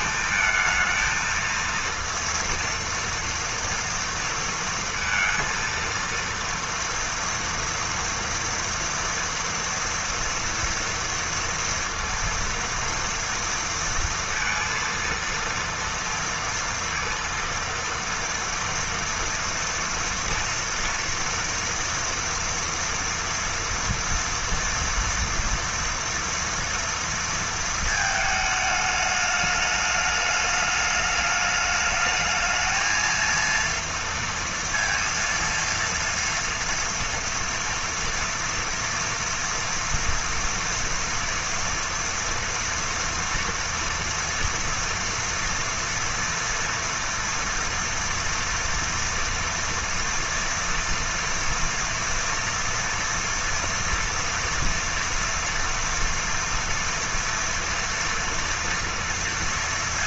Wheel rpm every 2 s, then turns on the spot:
230, 230, 230, 230, 230, 230, 230, 230, 230, 230, 230, 230, 230, 230, 210, 210, 220, 230, 240, 240, 230, 230, 230, 230, 230, 230, 230, 230, 230, 230.
none